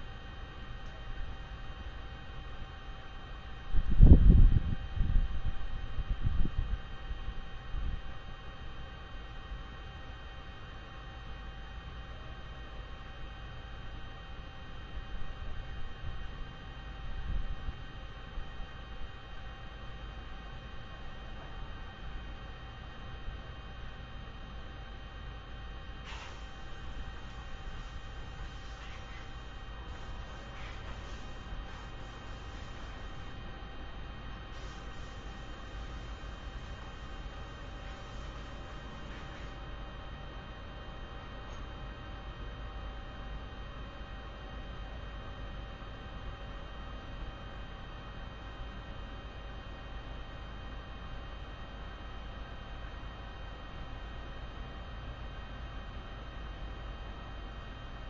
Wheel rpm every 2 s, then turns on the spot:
0, 0, 0, 0, 0, 0, 0, 0, 0, 0, 0, 0, 0, 0, 0, 0, 0, 0, 0, 0, 0, 0, 0, 0, 0, 0, 0, 0, 0.
none